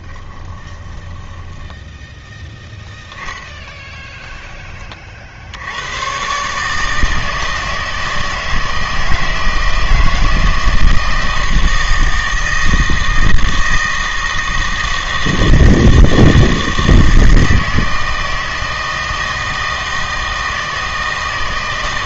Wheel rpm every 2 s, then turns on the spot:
10, 0, 20, 150, 160, 160, 160, 160, 160, 160, 160.
0-2